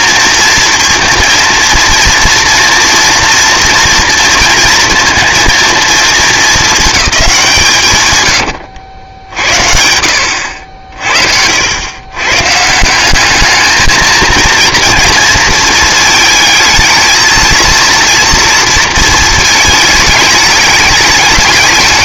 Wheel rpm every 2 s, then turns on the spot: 230, 230, 230, 220, 80, 70, 160, 230, 220, 230, 210.
8-10